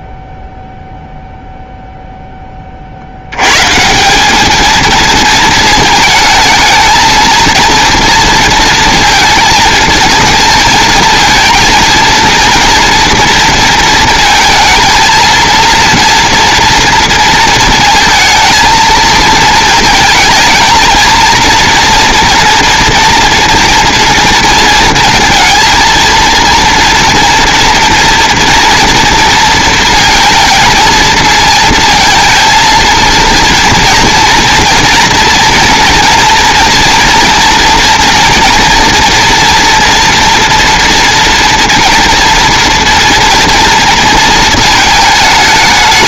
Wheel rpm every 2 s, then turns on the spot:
0, 50, 220, 220, 230, 230, 240, 230, 230, 220, 230, 230, 230, 230, 230, 220, 230, 230, 230, 230, 230, 230, 220.
none